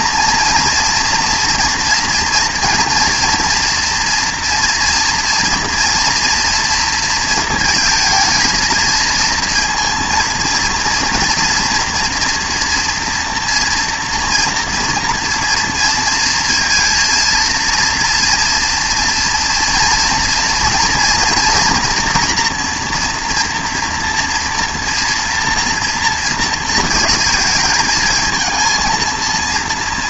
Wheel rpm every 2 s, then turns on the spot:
230, 230, 230, 230, 230, 230, 240, 230, 230, 230, 240, 240, 230, 230, 220.
none